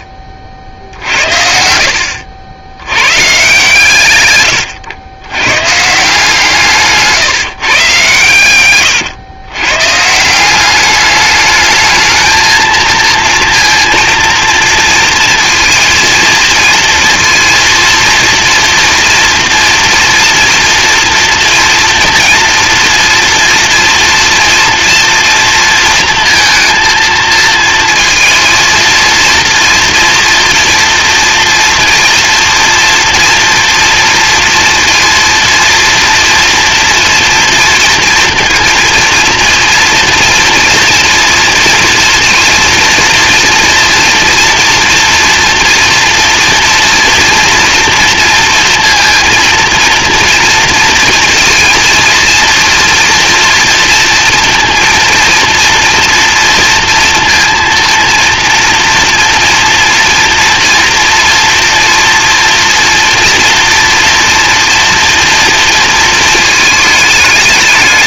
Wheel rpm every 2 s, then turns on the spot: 60, 80, 80, 160, 120, 190, 220, 230, 230, 230, 240, 230, 230, 230, 230, 230, 230, 230, 230, 230, 230, 230, 240, 240, 230, 230, 230, 230, 230, 230, 230, 230, 230, 220.
4-6